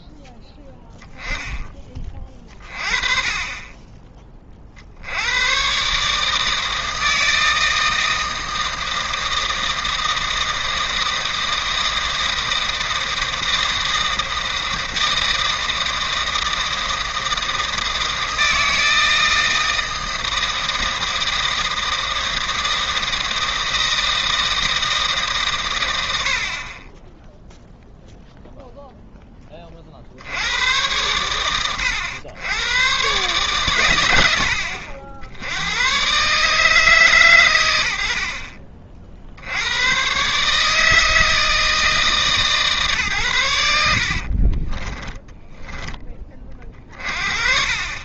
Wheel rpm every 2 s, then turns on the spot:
10, 30, 60, 160, 160, 160, 160, 160, 160, 160, 160, 160, 160, 30, 0, 100, 120, 70, 150, 30, 150, 140, 30, 40.
26-28 44-46